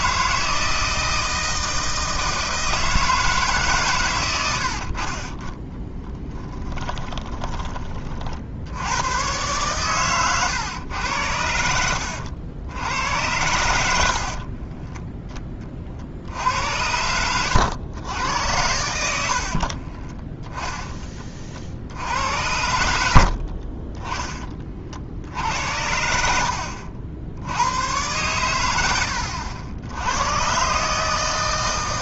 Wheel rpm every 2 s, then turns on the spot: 160, 160, 80, 10, 80, 110, 80, 30, 90, 100, 10, 80, 40, 70, 90, 140.
6-8 14-18 26-28